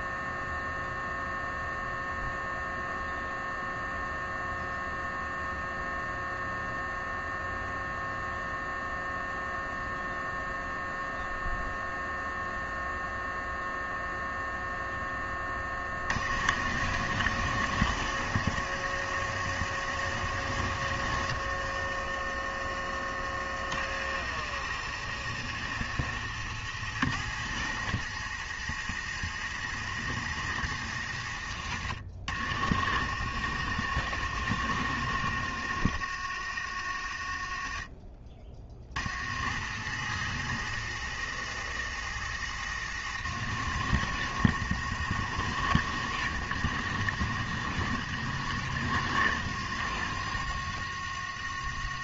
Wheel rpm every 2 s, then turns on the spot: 0, 0, 0, 0, 0, 0, 0, 10, 60, 70, 50, 40, 70, 70, 70, 60, 70, 60, 40, 40, 60, 60, 70, 60, 70, 50.
20-22